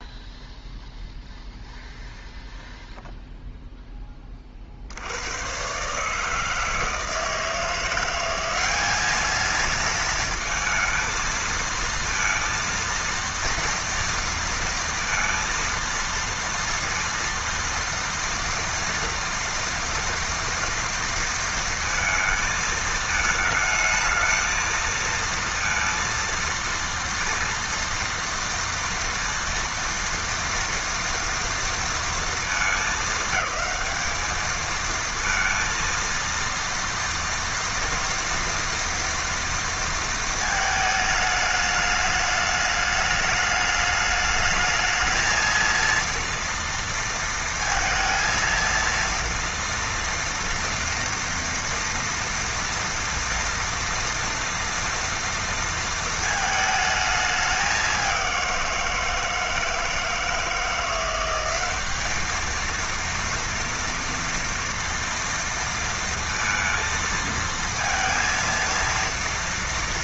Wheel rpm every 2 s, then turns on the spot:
0, 0, 30, 150, 190, 230, 230, 230, 230, 230, 230, 220, 220, 230, 230, 230, 220, 220, 230, 230, 220, 210, 210, 230, 230, 230, 230, 230, 220, 180, 160, 220, 230, 230, 230.
none